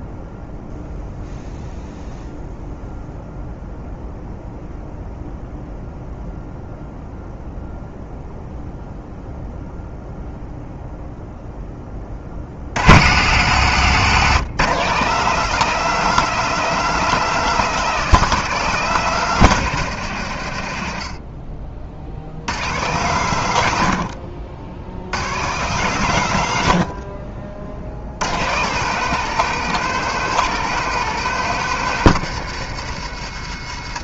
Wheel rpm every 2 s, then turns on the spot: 0, 0, 0, 0, 0, 0, 60, 150, 200, 190, 100, 110, 70, 100, 140, 190, 160.
none